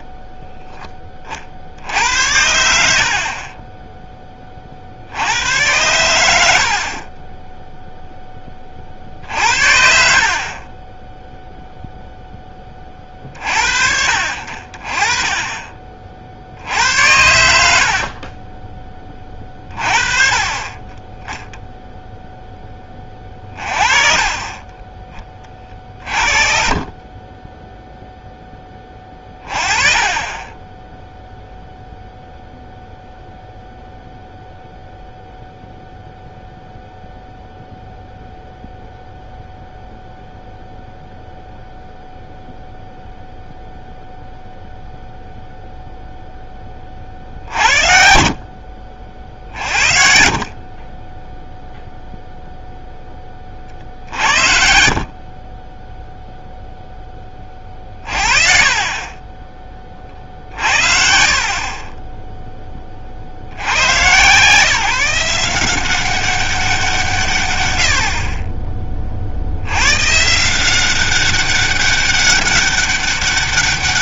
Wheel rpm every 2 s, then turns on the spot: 10, 60, 30, 60, 30, 30, 10, 50, 60, 30, 20, 10, 20, 30, 10, 20, 0, 0, 0, 0, 0, 0, 0, 20, 40, 30, 0, 60, 0, 30, 50, 20, 140, 180, 30, 160, 200.
54-56 58-62